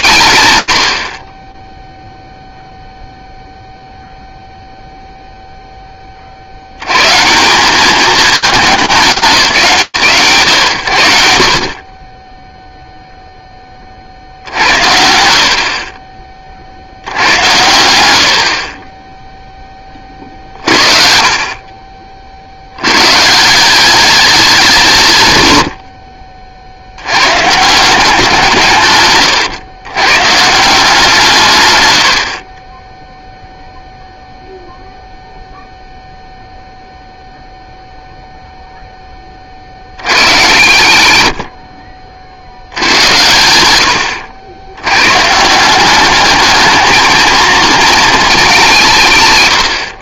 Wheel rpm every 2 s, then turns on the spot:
80, 0, 0, 150, 200, 100, 0, 60, 90, 20, 50, 160, 90, 160, 120, 120, 0, 0, 0, 40, 70, 100, 140, 220, 140.
none